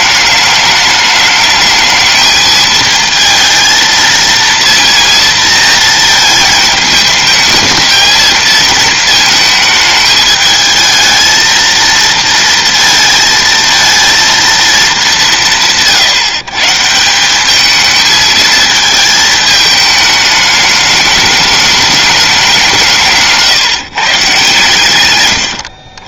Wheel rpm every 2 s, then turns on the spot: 210, 220, 230, 220, 220, 220, 230, 230, 150, 220, 210, 180, 130.
none